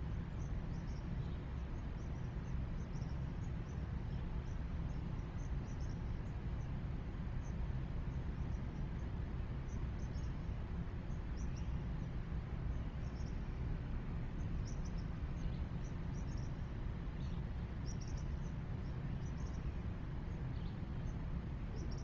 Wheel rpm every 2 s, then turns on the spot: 0, 0, 0, 0, 0, 0, 0, 0, 0, 0, 0.
none